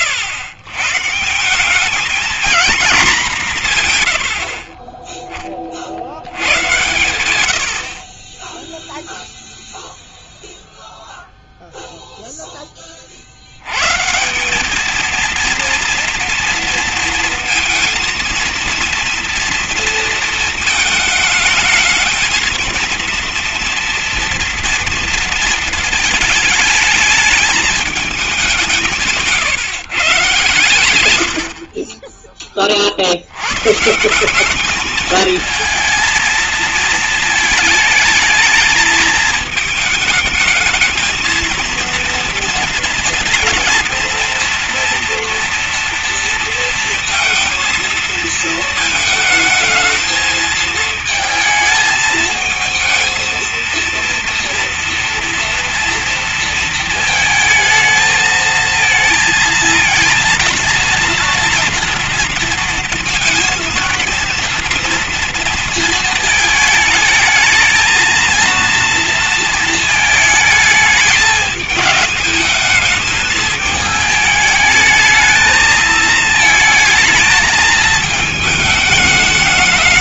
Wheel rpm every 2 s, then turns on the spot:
140, 220, 30, 100, 10, 0, 10, 190, 230, 230, 220, 230, 230, 220, 190, 100, 30, 190, 220, 220, 220, 230, 230, 230, 220, 220, 230, 240, 230, 230, 230, 230, 230, 220, 230, 220, 210, 220, 220, 210.
none